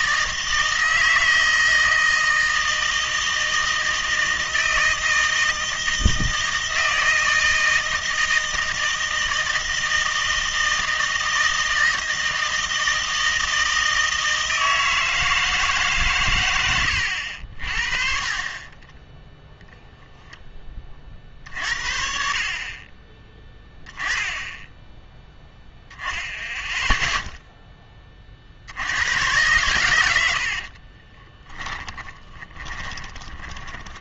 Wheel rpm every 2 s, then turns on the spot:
160, 160, 160, 160, 160, 160, 160, 160, 100, 20, 20, 40, 10, 0, 60, 50, 20.
18-20 30-34